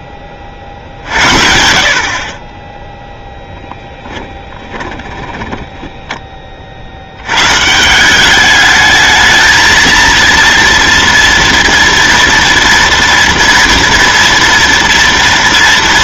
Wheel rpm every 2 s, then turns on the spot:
20, 40, 10, 30, 190, 230, 230, 230.
4-8